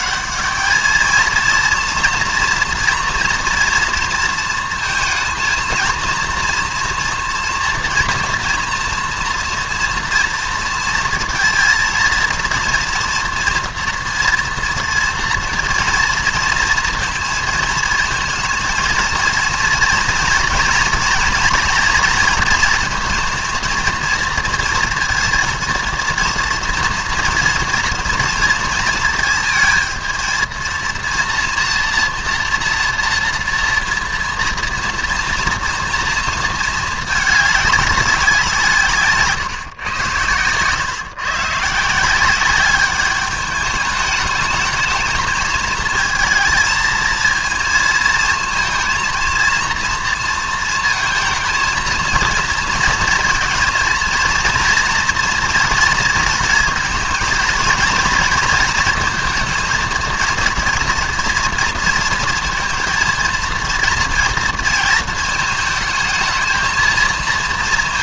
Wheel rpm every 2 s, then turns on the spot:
200, 230, 230, 230, 230, 230, 230, 240, 230, 220, 230, 230, 230, 230, 230, 220, 240, 230, 230, 190, 120, 180, 210, 220, 230, 230, 230, 230, 230, 230, 230, 230, 230, 220.
none